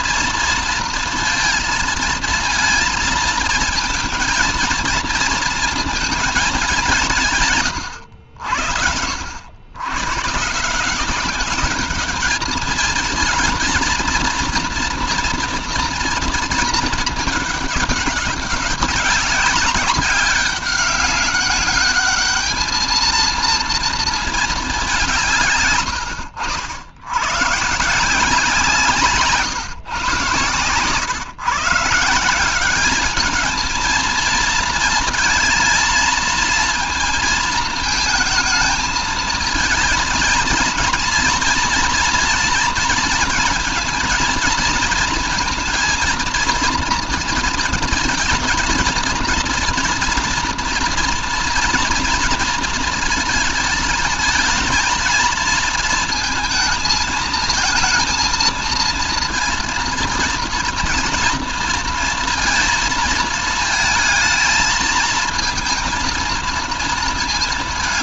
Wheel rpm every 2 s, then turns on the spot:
230, 230, 230, 180, 80, 180, 220, 230, 220, 200, 200, 220, 190, 90, 170, 130, 200, 230, 230, 220, 230, 230, 230, 230, 230, 230, 230, 220, 220, 230, 230, 220, 220, 220.
none